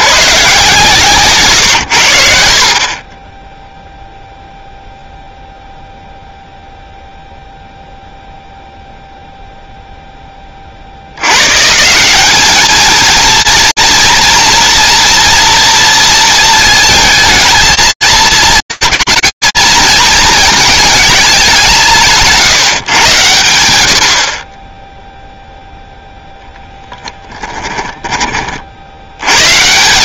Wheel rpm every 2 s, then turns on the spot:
70, 110, 0, 0, 0, 40, 220, 230, 220, 220, 220, 150, 20, 10, 60.
none